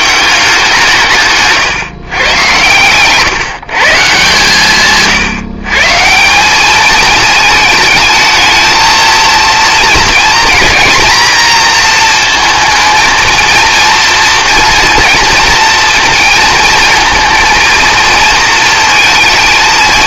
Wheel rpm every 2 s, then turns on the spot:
180, 120, 140, 210, 220, 240, 230, 240, 230, 220.
none